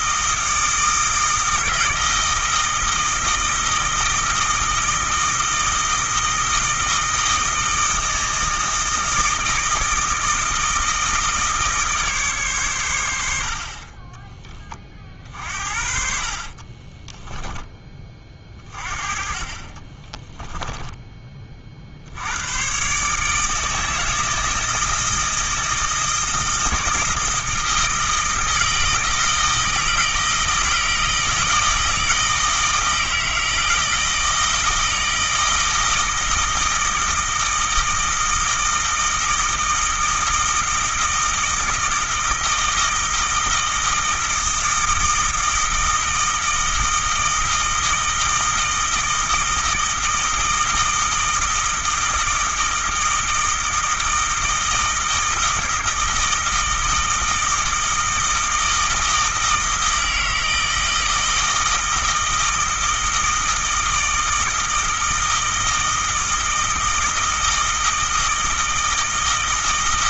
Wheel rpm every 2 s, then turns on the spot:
160, 160, 160, 160, 160, 160, 110, 30, 20, 40, 10, 130, 160, 160, 160, 160, 160, 160, 160, 160, 160, 160, 160, 160, 160, 160, 160, 160, 160, 160, 160, 160, 160, 160, 160.
16-18